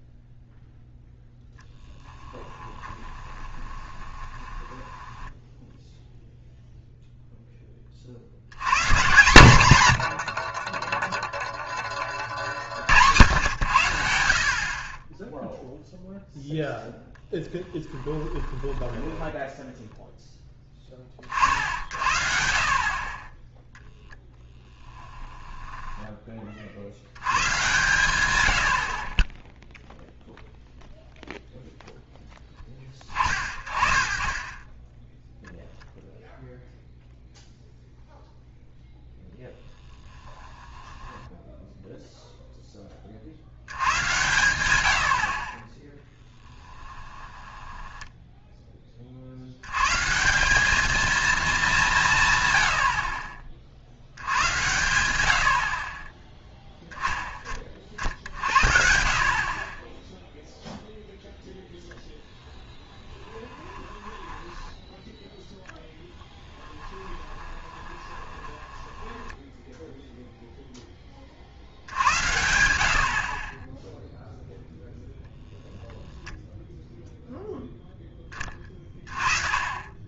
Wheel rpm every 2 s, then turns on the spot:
0, 10, 10, 0, 140, 20, 60, 40, 0, 10, 10, 50, 20, 40, 80, 0, 20, 20, 0, 10, 10, 10, 100, 10, 20, 200, 90, 110, 10, 60, 0, 20, 10, 20, 10, 0, 70, 10, 0, 20.
2-6 18-20 24-26 40-42 46-48 62-70